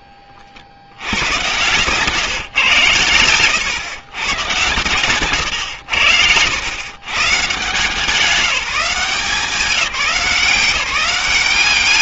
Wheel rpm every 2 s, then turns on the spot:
100, 120, 130, 100, 190, 190.
none